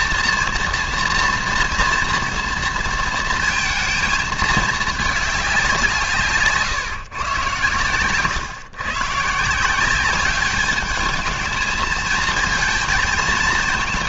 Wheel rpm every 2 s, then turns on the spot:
230, 230, 220, 140, 120, 210, 220.
none